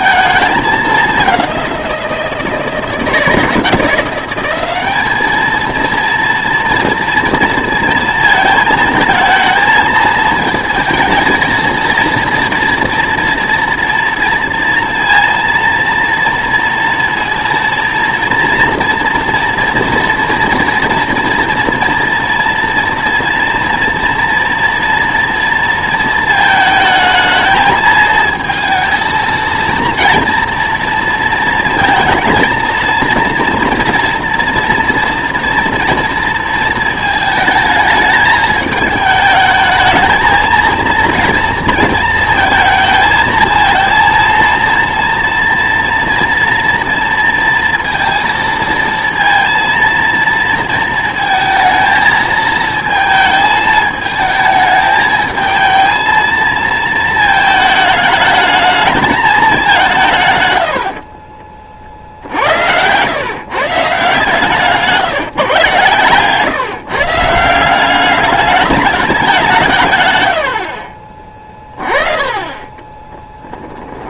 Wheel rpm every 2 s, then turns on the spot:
210, 170, 200, 230, 230, 220, 230, 230, 230, 230, 230, 230, 230, 220, 220, 230, 230, 230, 220, 210, 230, 220, 230, 230, 230, 220, 220, 220, 230, 220, 80, 90, 150, 140, 210, 60, 30.
60-62 70-74